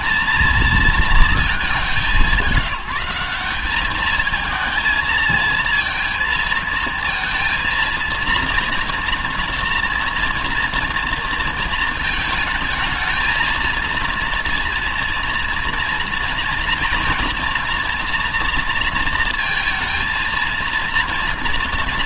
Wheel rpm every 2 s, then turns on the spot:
230, 170, 220, 230, 230, 240, 220, 230, 230, 230, 230.
none